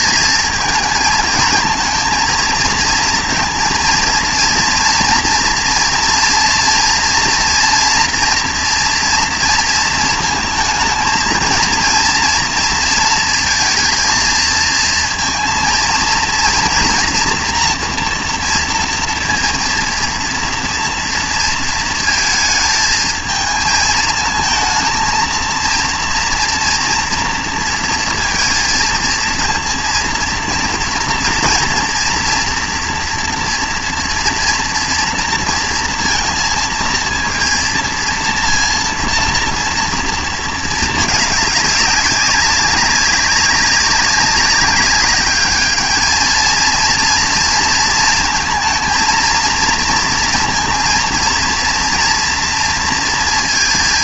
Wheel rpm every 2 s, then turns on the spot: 220, 230, 230, 230, 230, 230, 230, 230, 230, 240, 230, 220, 230, 230, 230, 230, 230, 230, 230, 230, 220, 190, 200, 230, 220, 230, 230.
none